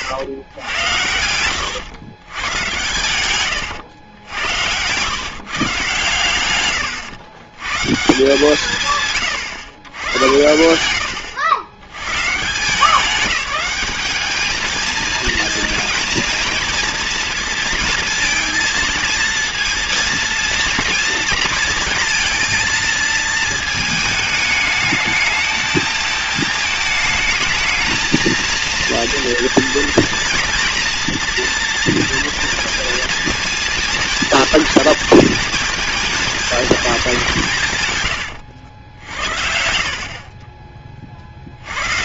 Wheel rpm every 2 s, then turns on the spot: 100, 100, 90, 120, 160, 100, 170, 220, 230, 230, 230, 230, 210, 220, 230, 240, 230, 230, 230, 80, 40.
none